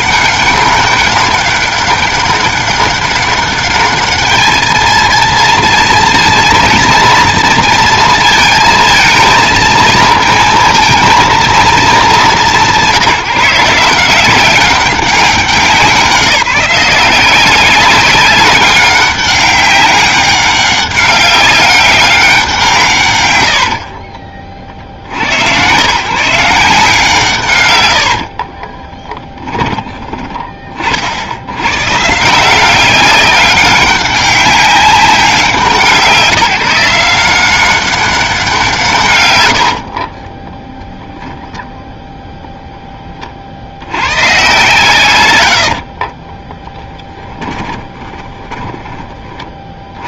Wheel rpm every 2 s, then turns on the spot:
200, 200, 220, 230, 230, 230, 160, 190, 180, 200, 190, 140, 90, 160, 10, 40, 190, 200, 170, 150, 10, 10, 140, 10, 20.
28-30 46-50